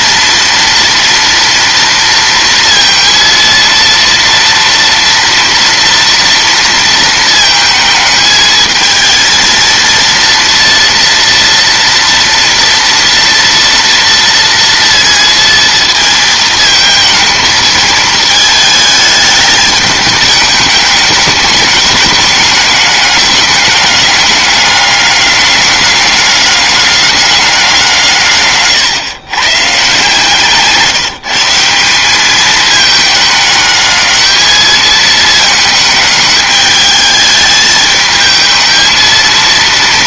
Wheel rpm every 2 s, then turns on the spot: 230, 230, 230, 230, 220, 230, 230, 230, 220, 220, 210, 210, 200, 200, 130, 150, 220, 220, 210, 220.
none